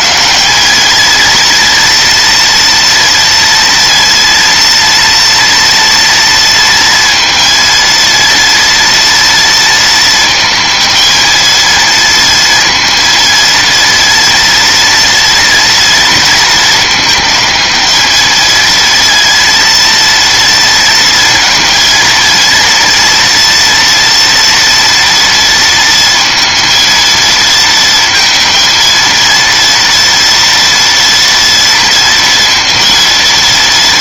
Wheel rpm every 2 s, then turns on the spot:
220, 230, 230, 230, 230, 230, 230, 230, 230, 220, 230, 230, 240, 230, 230, 230, 230.
none